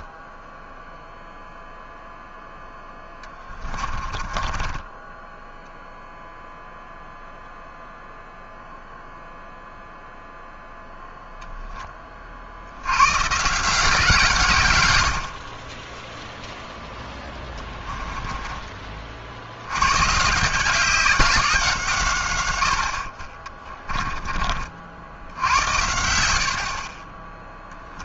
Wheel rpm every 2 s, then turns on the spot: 0, 0, 20, 0, 0, 0, 70, 120, 0, 20, 180, 80, 50, 40.
4-6